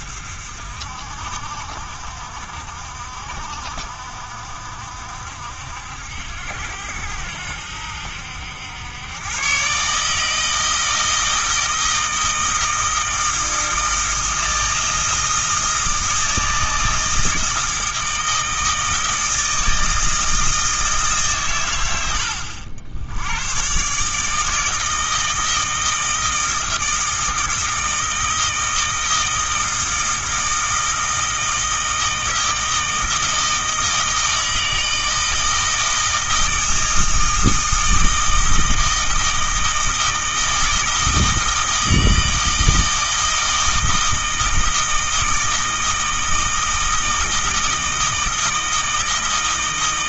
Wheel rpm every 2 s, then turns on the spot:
60, 60, 60, 80, 100, 160, 160, 160, 160, 160, 150, 90, 160, 160, 160, 160, 160, 160, 160, 160, 160, 160, 160, 160, 160.
none